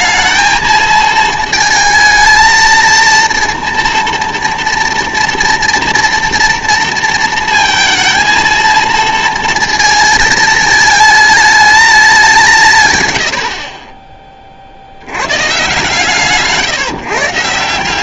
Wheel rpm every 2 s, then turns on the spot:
220, 230, 230, 230, 230, 220, 150, 50, 140.
none